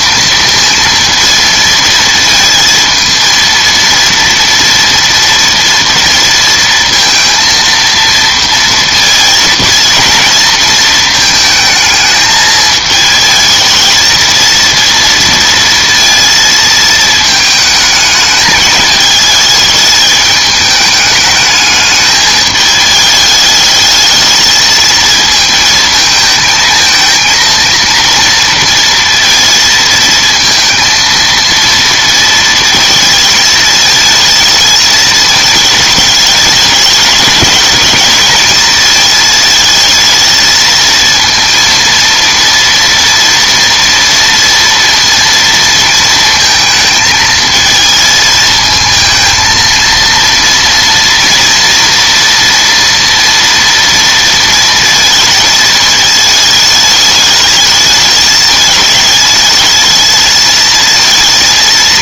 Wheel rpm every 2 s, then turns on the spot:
230, 230, 230, 230, 230, 230, 220, 230, 230, 210, 210, 210, 220, 220, 230, 230, 220, 220, 210, 230, 220, 230, 230, 230, 220, 230, 230, 230, 220, 210, 220.
none